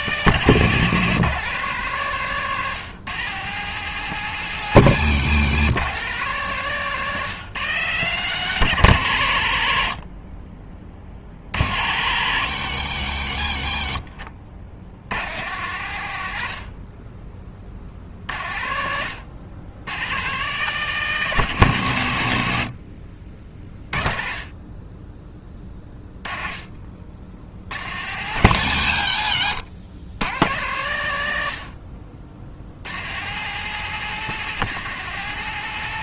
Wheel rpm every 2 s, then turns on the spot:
150, 150, 140, 150, 120, 40, 100, 80, 40, 80, 160, 40, 10, 50, 100, 110, 110, 180.
none